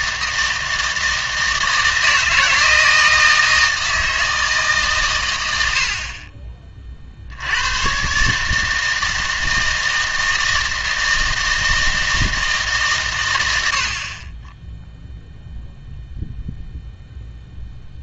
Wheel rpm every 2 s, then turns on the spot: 160, 170, 150, 30, 150, 160, 150, 0, 0.
none